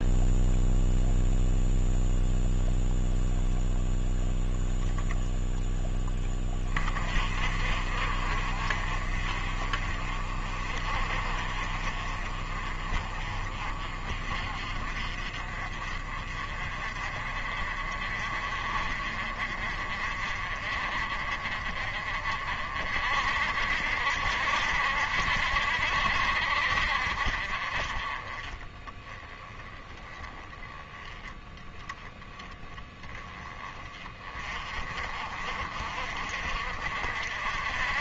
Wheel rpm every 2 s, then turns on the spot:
0, 0, 0, 30, 40, 40, 40, 40, 40, 40, 40, 50, 70, 50, 20, 10, 20, 40, 50.
none